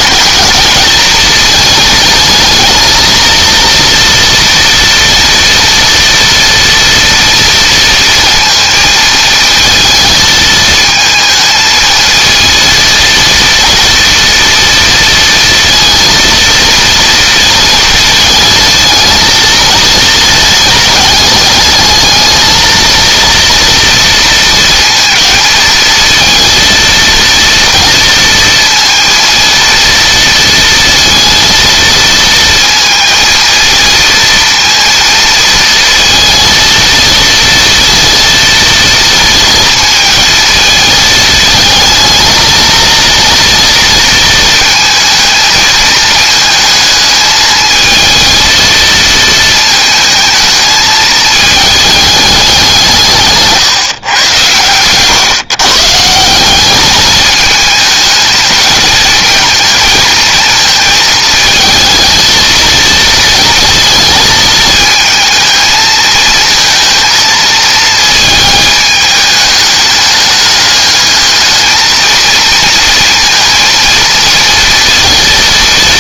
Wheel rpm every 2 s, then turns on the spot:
210, 220, 230, 240, 230, 220, 230, 230, 230, 220, 210, 220, 220, 230, 230, 230, 230, 230, 230, 230, 220, 230, 230, 220, 230, 220, 180, 120, 200, 220, 220, 230, 220, 220, 210, 210, 230, 230.
none